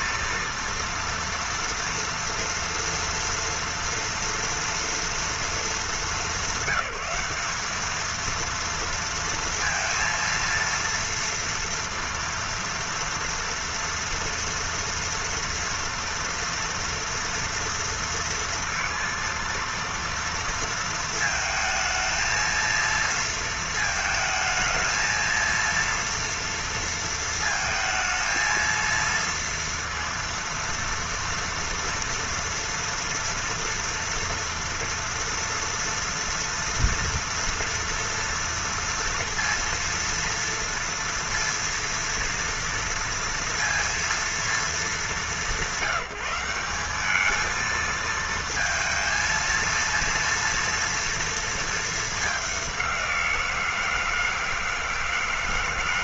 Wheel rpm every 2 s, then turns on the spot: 230, 230, 230, 200, 220, 230, 230, 230, 240, 230, 230, 230, 220, 230, 220, 230, 230, 230, 230, 230, 230, 230, 230, 180, 230, 230, 210, 160.
none